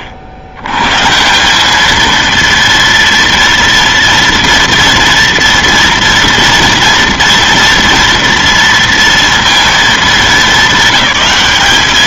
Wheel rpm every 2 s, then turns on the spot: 60, 230, 230, 230, 230, 200.
none